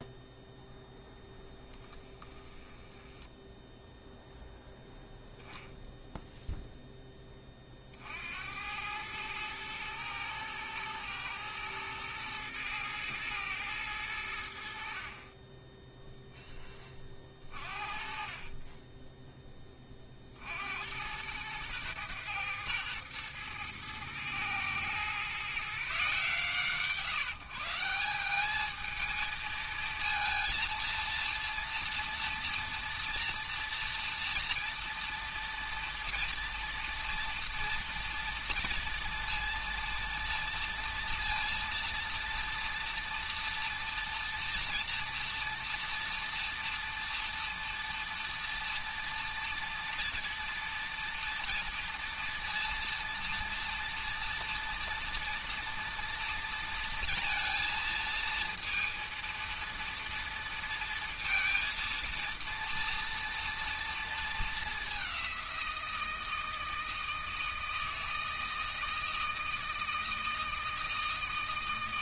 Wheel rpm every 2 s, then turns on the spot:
0, 10, 0, 0, 90, 110, 120, 60, 20, 20, 70, 110, 120, 150, 220, 230, 230, 230, 230, 230, 230, 230, 230, 230, 230, 230, 230, 230, 230, 230, 230, 230, 200, 160, 160, 160.
2-4